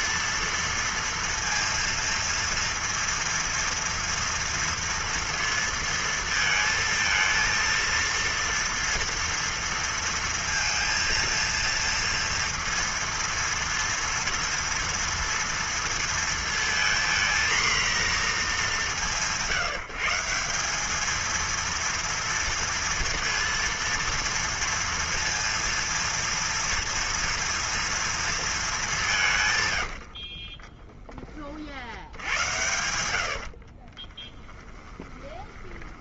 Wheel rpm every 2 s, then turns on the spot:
230, 230, 230, 230, 230, 230, 230, 230, 230, 200, 190, 230, 230, 230, 220, 30, 90, 10.
30-32 34-36